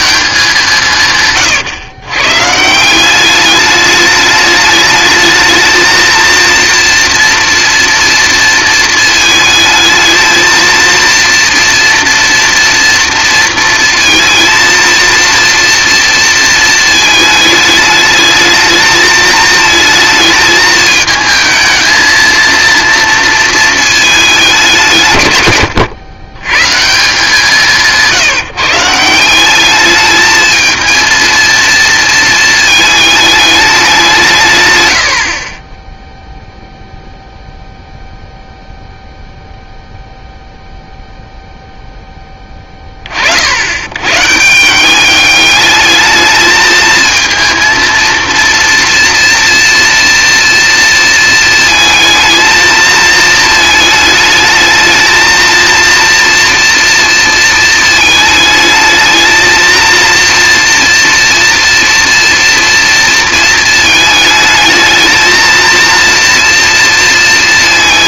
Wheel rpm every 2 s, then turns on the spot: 140, 200, 220, 230, 220, 230, 230, 230, 220, 220, 220, 230, 120, 170, 180, 230, 210, 50, 0, 0, 0, 40, 200, 220, 230, 230, 230, 220, 240, 220, 230, 230, 220, 230.
none